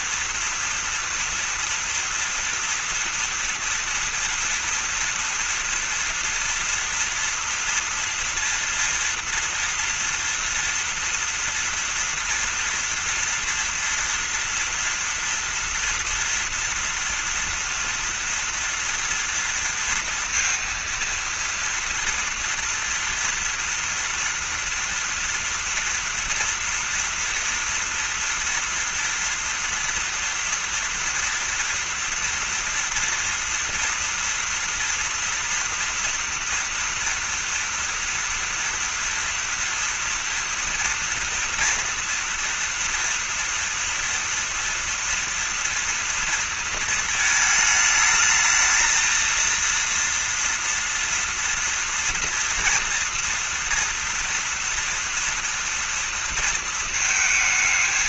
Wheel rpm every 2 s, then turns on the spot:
230, 240, 230, 230, 240, 230, 230, 230, 240, 230, 230, 230, 230, 230, 240, 230, 230, 230, 230, 230, 240, 230, 230, 230, 220, 230, 240, 230, 230.
none